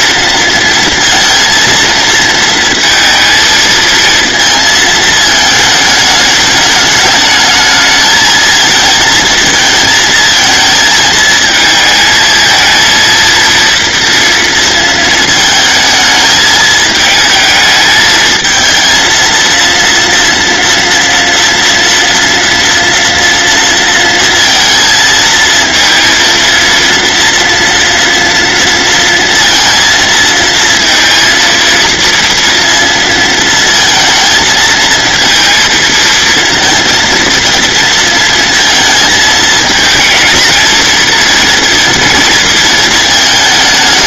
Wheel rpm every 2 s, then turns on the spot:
230, 230, 220, 210, 220, 220, 230, 230, 220, 220, 230, 230, 230, 230, 230, 230, 230, 220, 230, 230, 230, 220.
none